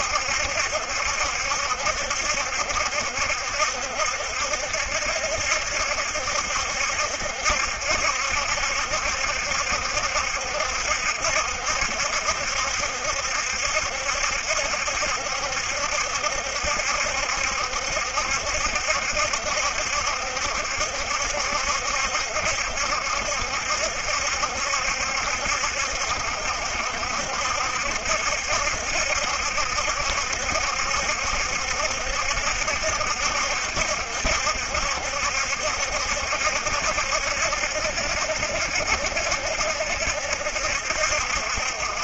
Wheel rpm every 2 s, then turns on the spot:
70, 70, 70, 70, 70, 70, 70, 70, 70, 70, 70, 70, 70, 70, 70, 70, 70, 70, 70, 70, 70.
none